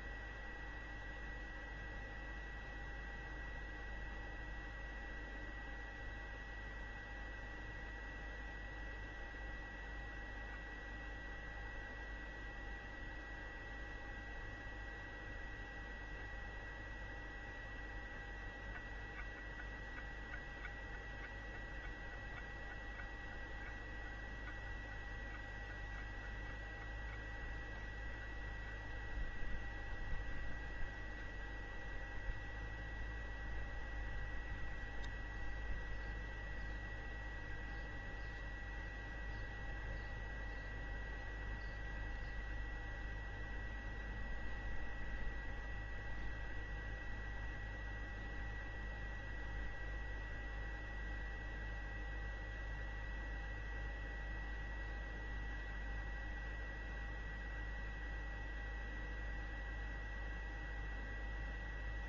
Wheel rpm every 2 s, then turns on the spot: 0, 0, 0, 0, 0, 0, 0, 0, 0, 0, 0, 0, 0, 0, 0, 0, 0, 0, 0, 0, 0, 0, 0, 0, 0, 0, 0, 0, 0, 0, 0.
none